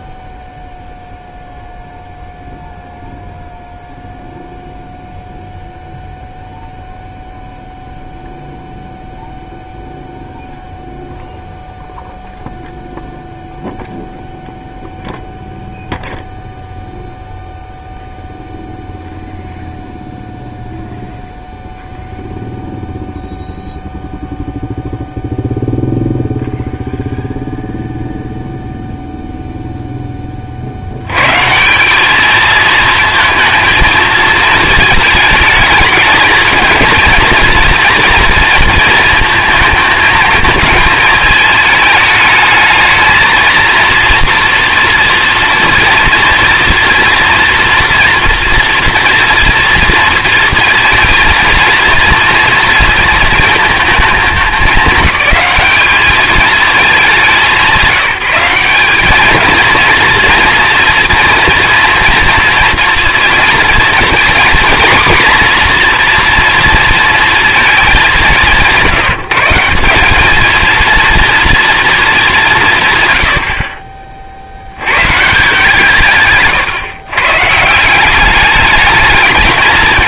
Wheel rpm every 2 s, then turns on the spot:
0, 0, 0, 0, 0, 0, 0, 0, 0, 0, 0, 0, 0, 0, 0, 60, 230, 220, 220, 230, 220, 220, 230, 230, 230, 230, 240, 210, 210, 200, 240, 230, 230, 230, 150, 230, 160, 90, 120, 210.
none